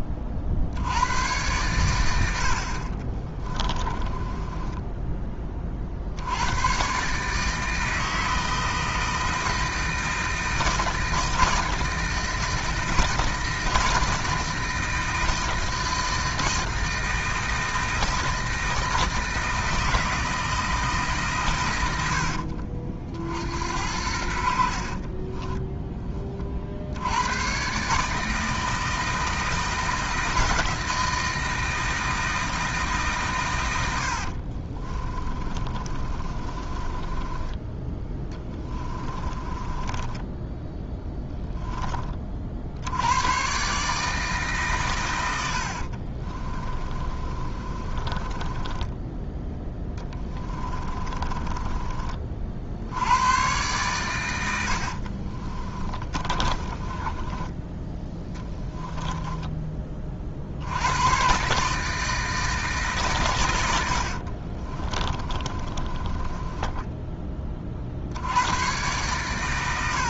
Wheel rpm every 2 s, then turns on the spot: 80, 40, 10, 130, 160, 160, 160, 160, 160, 160, 160, 50, 50, 60, 160, 160, 160, 40, 30, 20, 10, 70, 130, 20, 20, 30, 70, 60, 20, 10, 100, 150, 30, 10, 110.
2-6 24-26 34-42 46-52 54-60 64-68